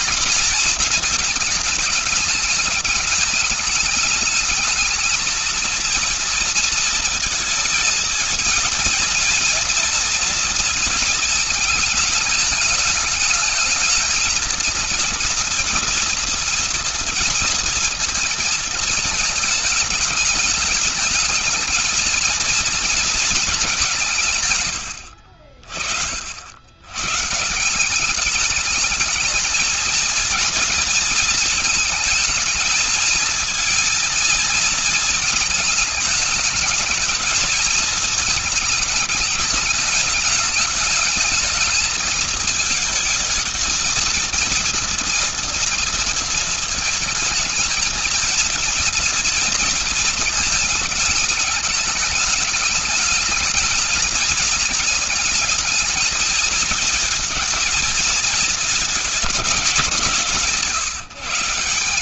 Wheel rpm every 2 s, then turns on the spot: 230, 220, 220, 230, 220, 230, 210, 230, 240, 230, 210, 230, 110, 100, 210, 230, 230, 230, 210, 210, 210, 220, 230, 220, 230, 220, 220, 210, 220, 220, 170.
none